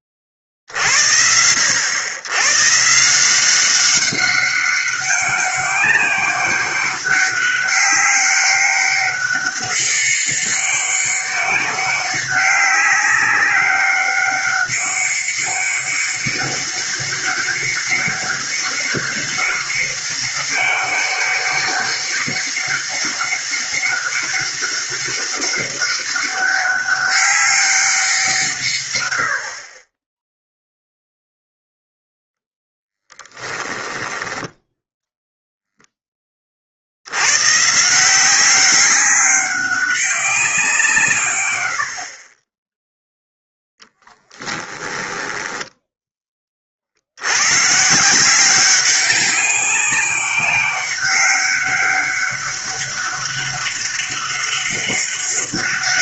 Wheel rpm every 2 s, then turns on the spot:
30, 130, 200, 200, 200, 200, 190, 200, 200, 200, 200, 200, 200, 200, 140, 0, 0, 0, 50, 190, 170, 10, 10, 40, 190, 200, 200, 200.
44-46